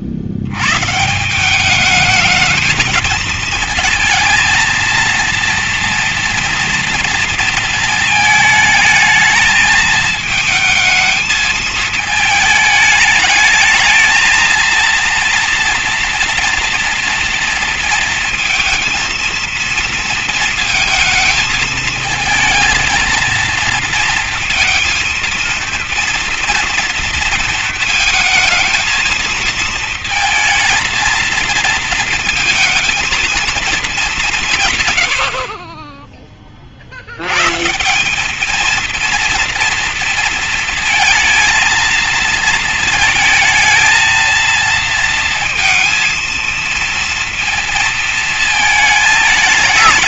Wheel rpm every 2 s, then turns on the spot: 140, 220, 230, 230, 220, 220, 210, 230, 230, 230, 230, 230, 230, 240, 220, 230, 230, 130, 70, 230, 230, 230, 230, 230, 220.
none